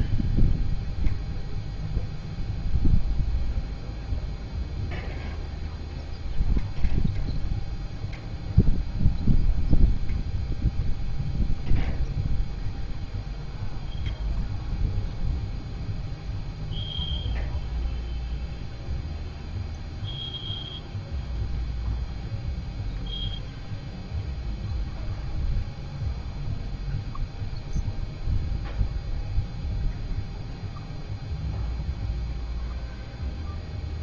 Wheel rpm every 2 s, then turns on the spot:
0, 0, 0, 0, 0, 0, 0, 0, 0, 0, 0, 0, 0, 0, 0, 0, 0.
none